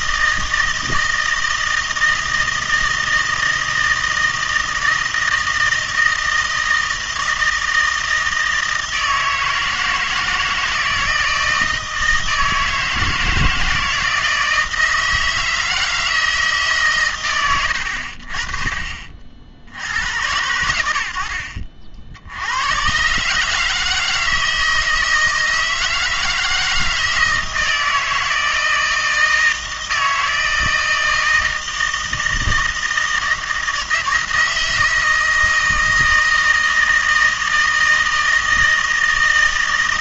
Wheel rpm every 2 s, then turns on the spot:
160, 160, 160, 160, 160, 160, 160, 160, 150, 40, 90, 100, 160, 160, 160, 160, 160, 160, 160, 160.
none